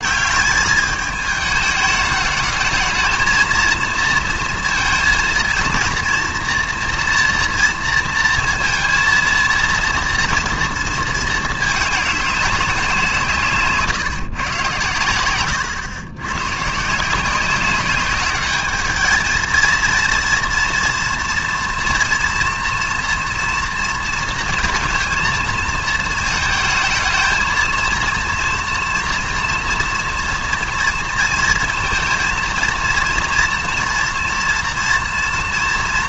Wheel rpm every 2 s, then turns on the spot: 190, 220, 230, 230, 230, 230, 190, 130, 130, 210, 230, 230, 230, 220, 230, 230, 230, 230.
none